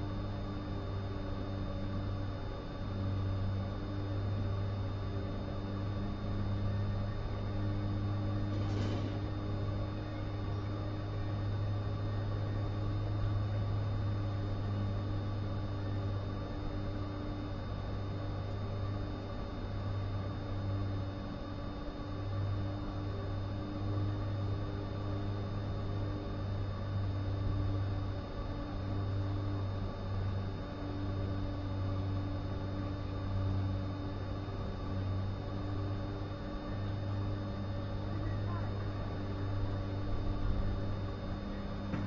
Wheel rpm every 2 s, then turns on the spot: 0, 0, 0, 0, 0, 0, 0, 0, 0, 0, 0, 0, 0, 0, 0, 0, 0, 0, 0, 0, 0.
none